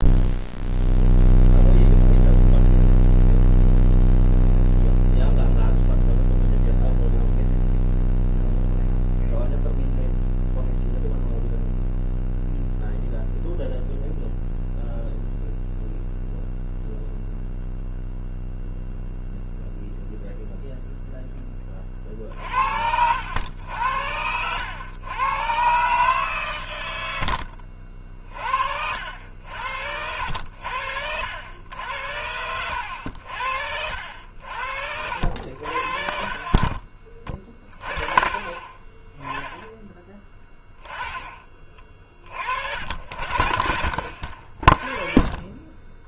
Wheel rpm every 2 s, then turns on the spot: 0, 0, 0, 0, 0, 0, 0, 0, 0, 0, 0, 70, 100, 90, 60, 70, 80, 70, 50, 20, 10, 70, 40.
none